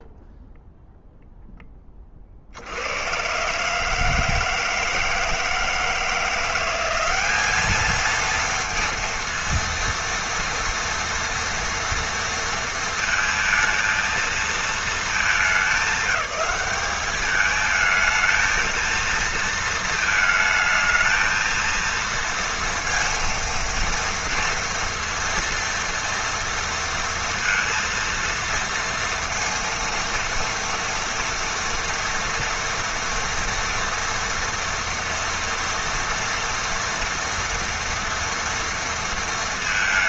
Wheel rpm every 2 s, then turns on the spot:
0, 110, 160, 200, 230, 230, 230, 210, 200, 230, 220, 230, 230, 230, 230, 230, 230, 230, 230, 210.
none